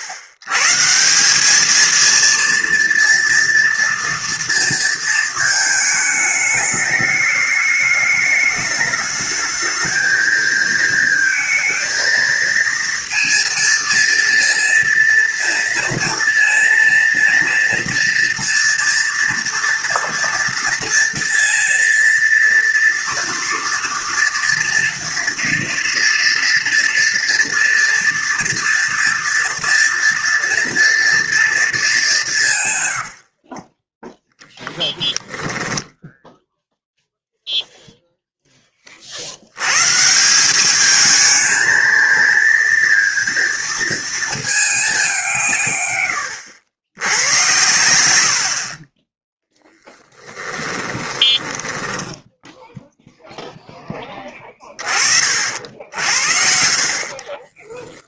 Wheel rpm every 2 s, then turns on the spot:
130, 230, 230, 210, 210, 230, 230, 230, 230, 230, 240, 230, 230, 230, 230, 230, 140, 10, 0, 10, 190, 230, 220, 90, 50, 20, 0, 20, 50.
34-36 50-52